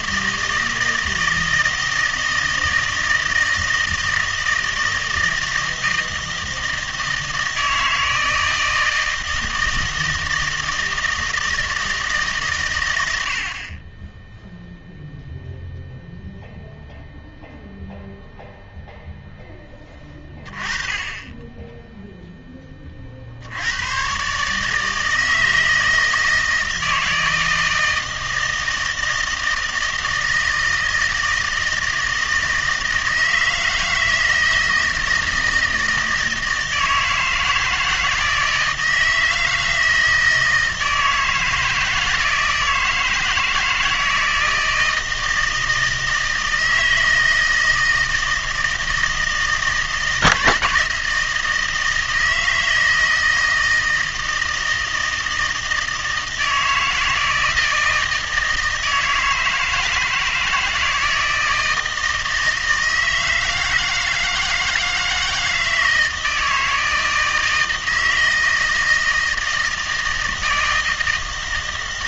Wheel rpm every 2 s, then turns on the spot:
160, 160, 160, 160, 160, 160, 130, 0, 0, 0, 20, 10, 150, 160, 160, 160, 160, 160, 160, 160, 160, 160, 160, 160, 160, 160, 160, 160, 160, 160, 160, 160, 160, 160, 160, 160.
none